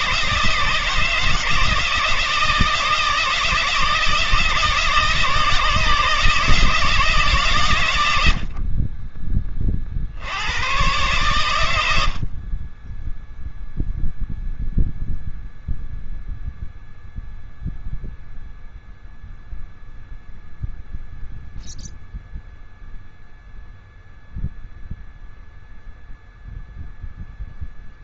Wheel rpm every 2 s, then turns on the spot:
160, 160, 160, 100, 60, 60, 0, 0, 0, 0, 0, 0, 0, 0.
none